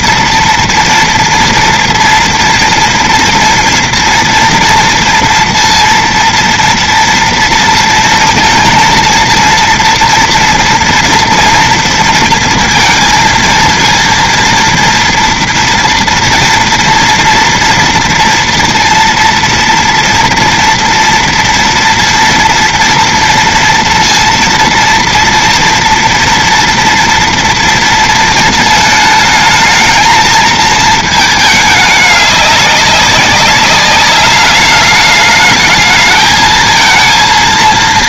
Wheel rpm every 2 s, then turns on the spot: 230, 230, 230, 230, 230, 230, 230, 230, 230, 230, 230, 240, 230, 230, 230, 220, 210, 200, 220.
none